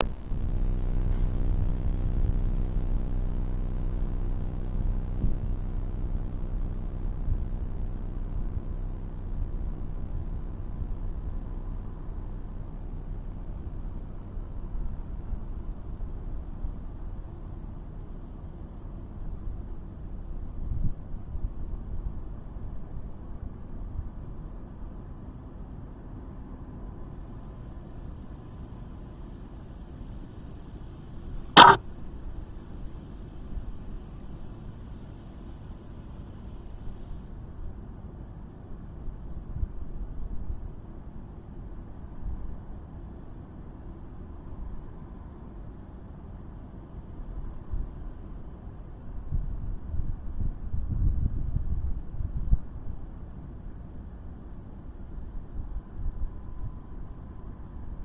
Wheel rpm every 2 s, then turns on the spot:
0, 0, 0, 0, 0, 0, 0, 0, 0, 0, 0, 0, 0, 0, 0, 0, 0, 0, 0, 0, 0, 0, 0, 0, 0, 0, 0, 0, 0.
none